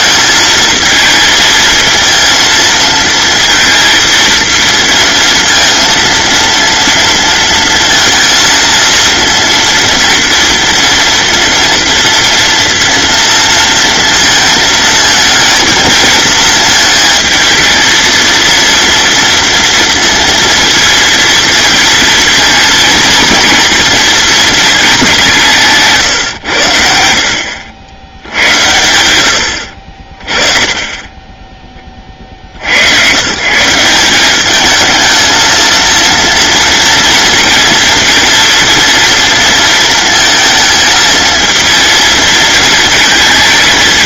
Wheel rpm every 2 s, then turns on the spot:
220, 230, 230, 230, 230, 230, 230, 220, 220, 230, 230, 230, 220, 80, 100, 20, 70, 210, 230, 230, 220, 230.
none